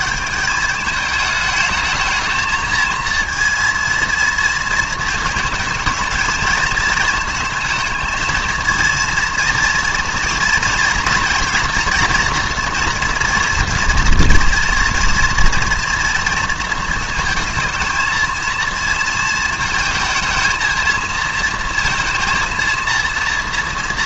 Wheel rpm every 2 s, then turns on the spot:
210, 220, 220, 220, 220, 230, 230, 230, 230, 230, 230, 230.
none